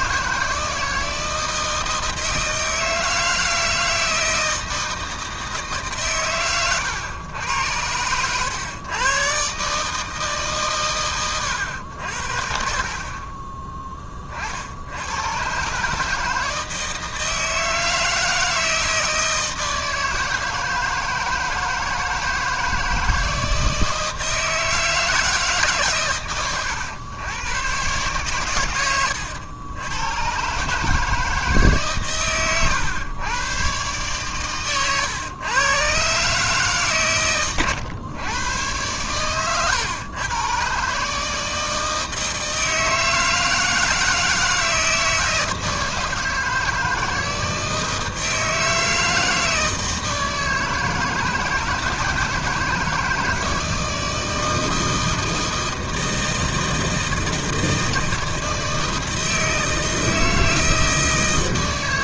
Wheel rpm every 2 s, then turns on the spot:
160, 160, 160, 110, 110, 140, 60, 60, 160, 160, 160, 160, 160, 110, 120, 130, 120, 130, 140, 110, 120, 160, 160, 170, 160, 160, 160, 160, 160, 160, 160.
none